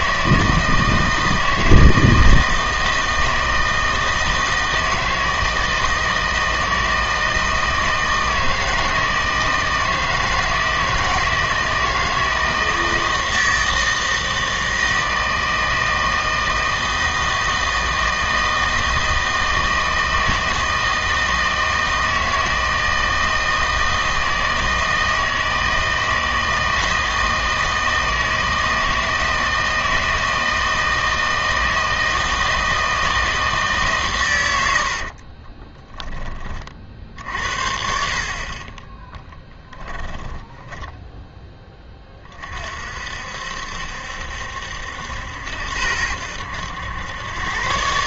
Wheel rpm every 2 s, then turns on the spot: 160, 160, 160, 160, 160, 160, 160, 160, 160, 160, 160, 160, 160, 160, 160, 160, 160, 90, 40, 30, 10, 40, 70, 90.
40-42